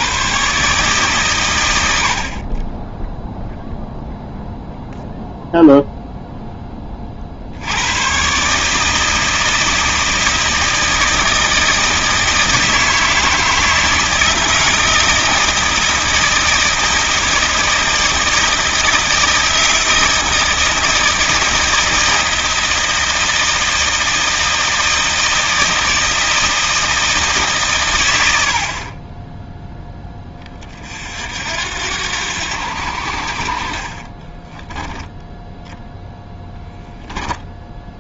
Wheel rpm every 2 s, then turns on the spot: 140, 30, 0, 10, 150, 160, 160, 160, 160, 160, 160, 160, 160, 160, 60, 30, 80, 10, 0.
34-36